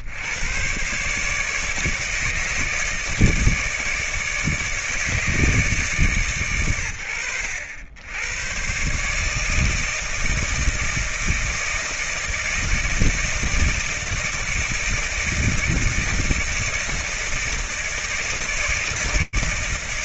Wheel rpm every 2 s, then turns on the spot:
120, 160, 150, 110, 140, 160, 160, 170, 160, 140.
none